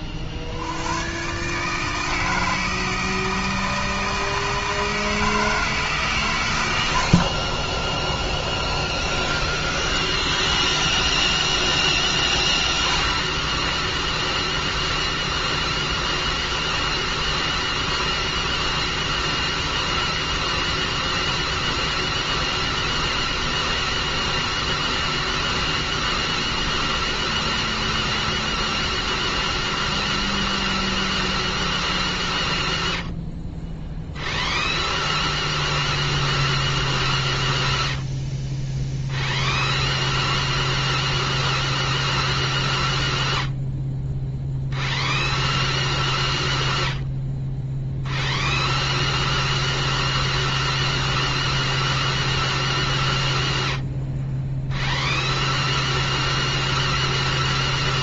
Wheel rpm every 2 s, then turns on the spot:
70, 160, 160, 100, 10, 10, 10, 0, 0, 0, 0, 0, 0, 0, 0, 0, 0, 0, 0, 0, 0, 0, 0, 0, 0, 0, 0, 0, 0.
8-12